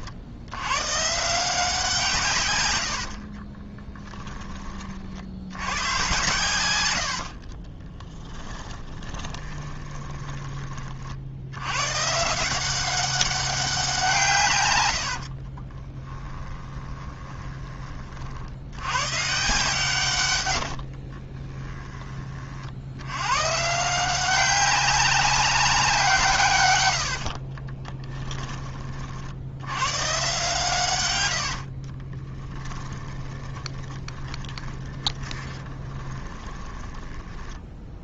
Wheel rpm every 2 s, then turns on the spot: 120, 80, 40, 90, 20, 40, 180, 100, 20, 110, 60, 90, 190, 110, 30, 120, 20, 20, 20.
2-4 6-10 14-18 20-22 32-38